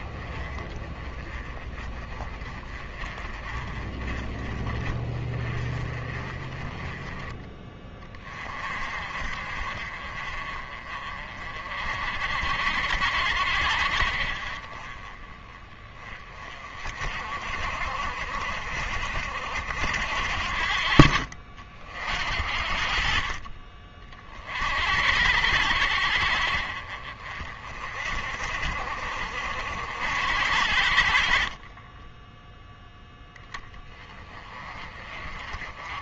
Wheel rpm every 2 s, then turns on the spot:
20, 30, 30, 20, 40, 40, 60, 30, 40, 50, 50, 50, 60, 50, 50, 60, 0, 30.
20-22